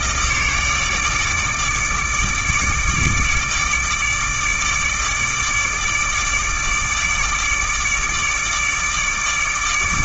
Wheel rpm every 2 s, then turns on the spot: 150, 150, 150, 150, 150.
none